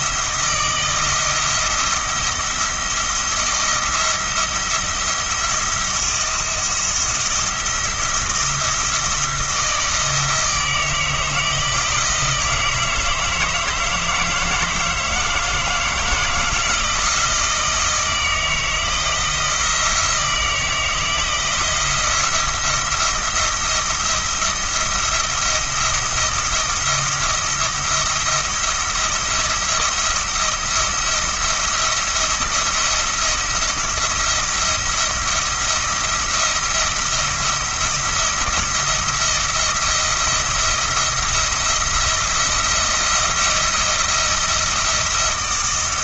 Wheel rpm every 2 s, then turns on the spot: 160, 170, 170, 170, 170, 160, 160, 160, 160, 160, 160, 170, 170, 170, 170, 170, 170, 170, 170, 170, 170, 170, 170.
none